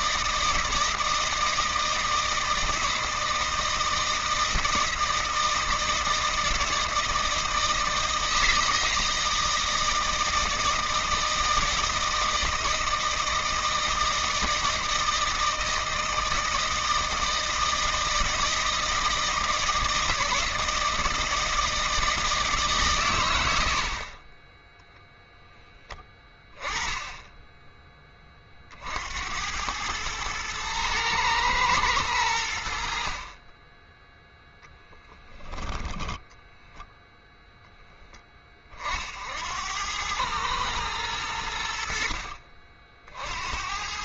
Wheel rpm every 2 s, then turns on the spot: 160, 160, 160, 160, 160, 160, 160, 160, 160, 160, 160, 140, 10, 20, 40, 110, 90, 0, 0, 30, 100, 60.
24-26